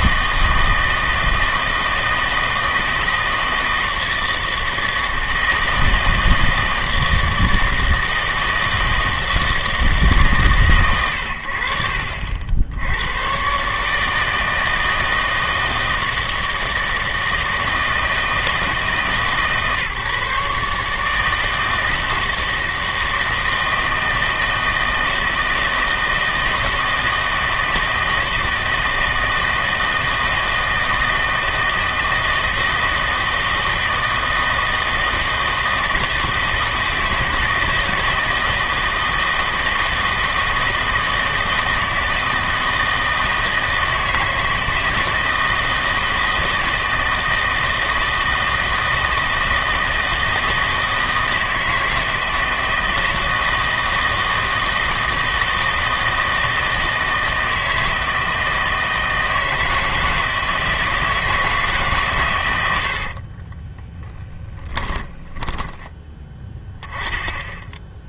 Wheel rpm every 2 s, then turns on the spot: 160, 160, 160, 160, 160, 130, 80, 160, 160, 160, 150, 160, 160, 160, 160, 160, 160, 160, 160, 160, 160, 160, 160, 160, 160, 160, 170, 160, 160, 160, 160, 80, 30, 10.
62-66